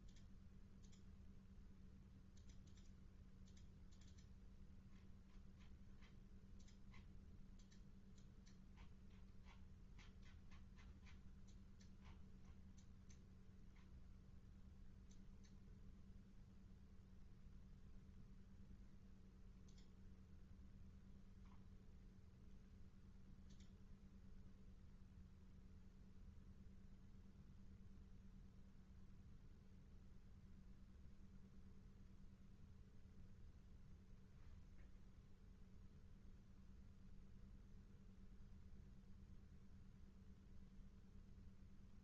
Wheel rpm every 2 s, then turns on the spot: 0, 0, 0, 0, 0, 0, 0, 0, 0, 0, 0, 0, 0, 0, 0, 0, 0, 0, 0, 0, 0.
none